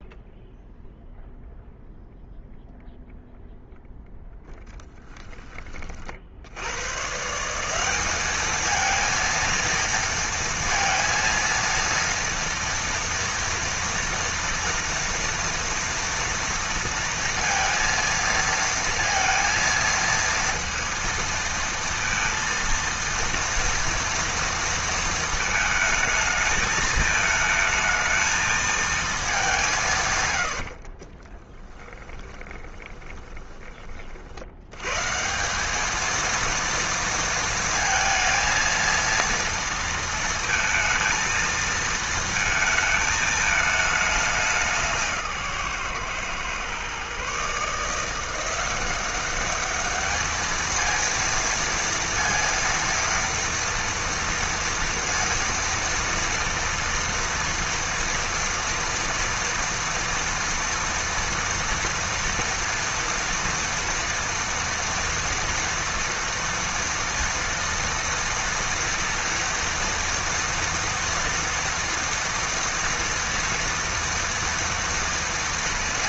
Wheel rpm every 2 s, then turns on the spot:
0, 0, 0, 50, 210, 230, 230, 240, 230, 230, 230, 230, 230, 220, 220, 120, 20, 60, 230, 230, 230, 230, 200, 130, 170, 210, 230, 230, 240, 230, 240, 230, 230, 230, 230, 230, 230, 230.
32-34